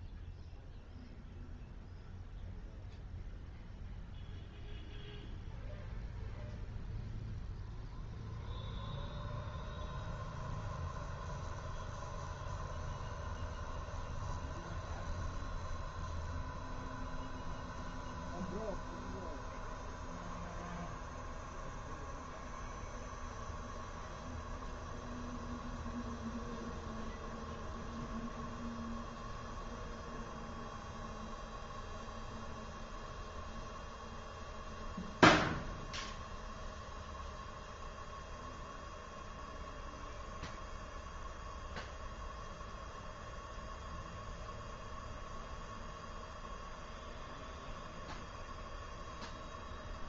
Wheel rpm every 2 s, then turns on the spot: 0, 0, 0, 0, 0, 0, 0, 0, 0, 0, 0, 0, 0, 0, 0, 0, 0, 0, 0, 0, 0, 0, 0, 0, 0.
none